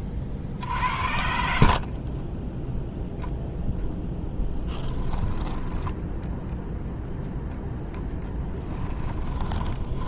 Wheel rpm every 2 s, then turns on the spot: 40, 0, 10, 0, 10.
4-6 8-10